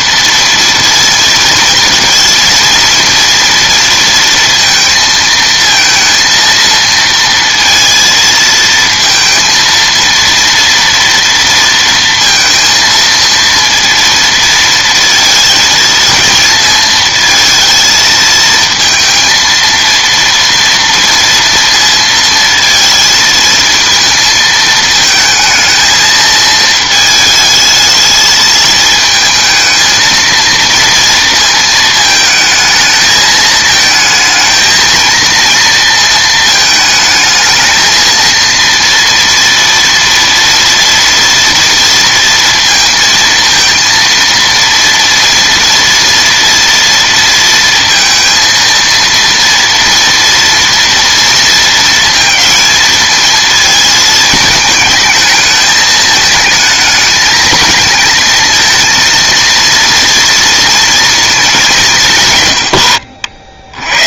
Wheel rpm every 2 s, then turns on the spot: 230, 230, 230, 230, 230, 230, 230, 230, 220, 230, 230, 230, 220, 220, 220, 230, 220, 220, 220, 230, 230, 230, 230, 230, 230, 230, 220, 220, 220, 220, 230, 140.
none